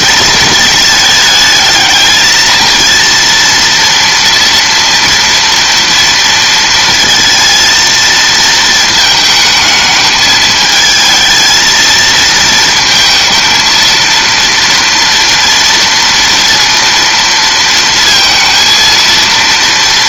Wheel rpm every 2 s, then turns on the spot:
220, 230, 230, 230, 220, 220, 230, 230, 230, 230.
none